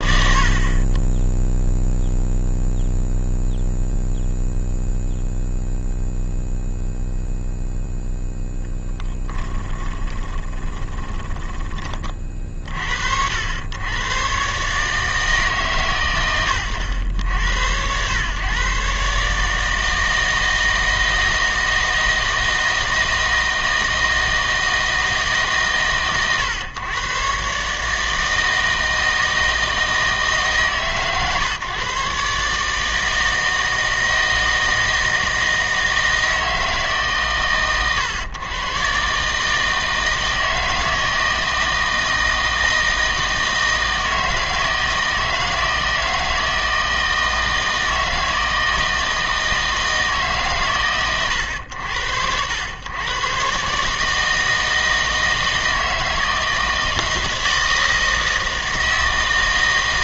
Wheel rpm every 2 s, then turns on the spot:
50, 0, 0, 0, 0, 20, 50, 130, 110, 120, 160, 160, 160, 120, 160, 150, 150, 160, 160, 120, 160, 160, 160, 160, 160, 140, 90, 160, 160, 160.
10-12